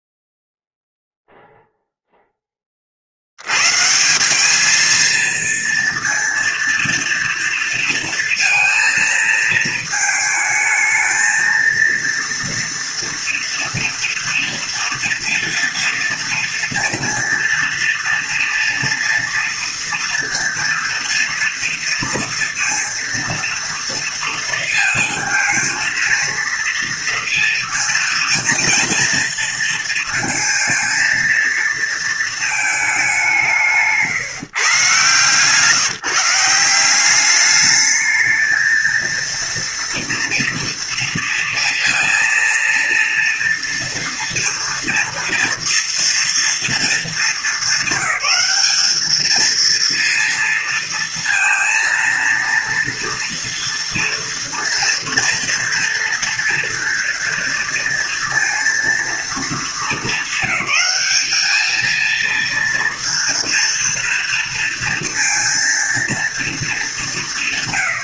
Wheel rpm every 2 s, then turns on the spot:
0, 20, 210, 230, 230, 220, 230, 230, 230, 230, 230, 230, 230, 230, 230, 230, 220, 150, 170, 220, 230, 230, 230, 230, 200, 230, 240, 230, 230, 230, 220, 230, 230, 220.
none